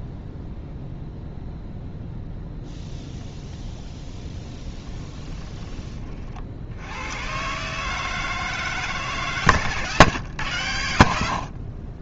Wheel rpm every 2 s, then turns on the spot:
0, 0, 20, 70, 150, 90.
4-6